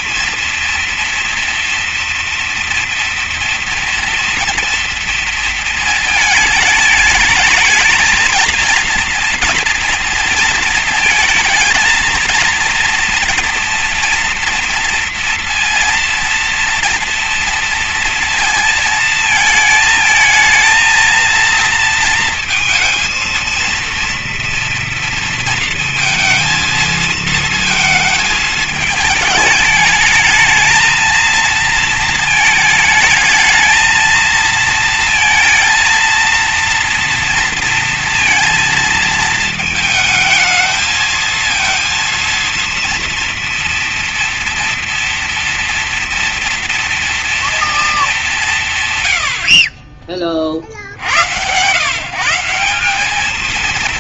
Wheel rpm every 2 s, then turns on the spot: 230, 230, 230, 220, 230, 230, 230, 230, 230, 220, 230, 230, 230, 220, 220, 220, 220, 220, 230, 230, 220, 230, 230, 230, 130, 70, 200.
none